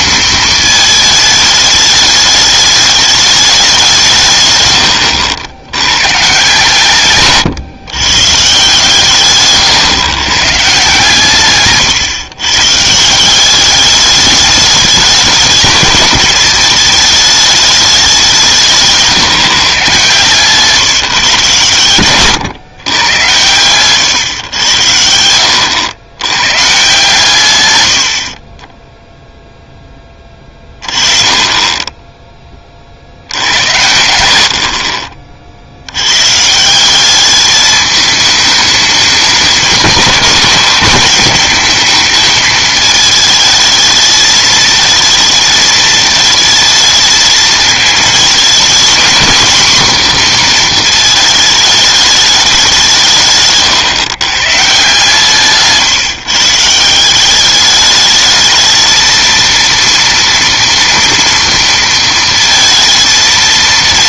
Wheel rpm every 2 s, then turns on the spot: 220, 210, 110, 150, 140, 140, 140, 210, 210, 170, 140, 130, 110, 130, 20, 30, 20, 70, 170, 210, 220, 220, 220, 220, 230, 240, 190, 140, 150, 220, 230, 230.
4-6 34-36